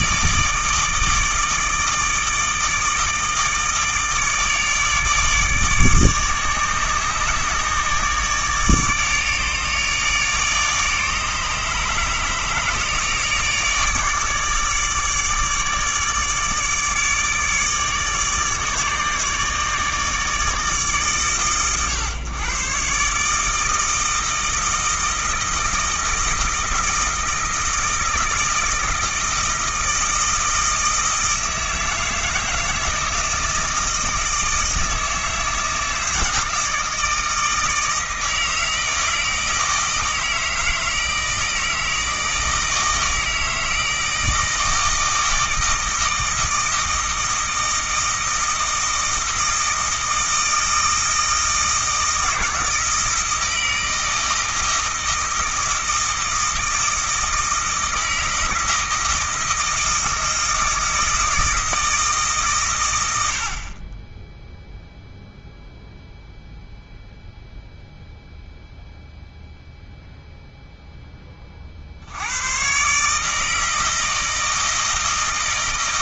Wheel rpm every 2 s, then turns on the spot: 160, 160, 150, 150, 150, 150, 150, 150, 150, 150, 140, 130, 160, 160, 160, 160, 160, 160, 160, 160, 160, 160, 160, 160, 160, 160, 160, 160, 160, 160, 160, 100, 0, 0, 0, 10, 140, 160.
none